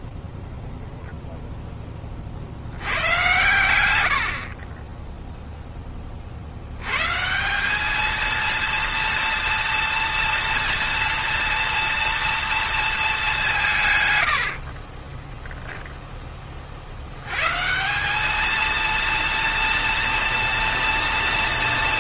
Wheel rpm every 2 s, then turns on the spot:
0, 70, 40, 110, 230, 230, 220, 40, 60, 230, 230.
14-16